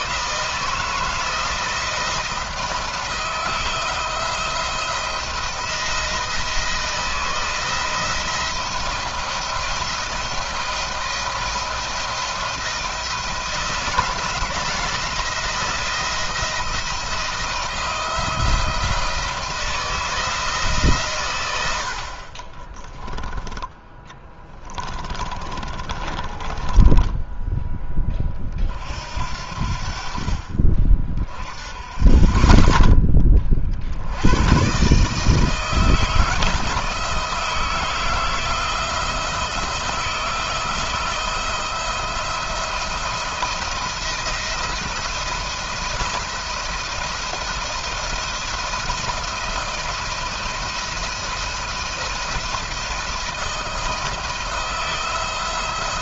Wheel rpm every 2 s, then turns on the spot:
160, 160, 170, 170, 170, 170, 170, 160, 170, 160, 150, 20, 20, 20, 40, 40, 30, 130, 160, 160, 160, 170, 170, 170, 170, 170, 170, 170.
22-28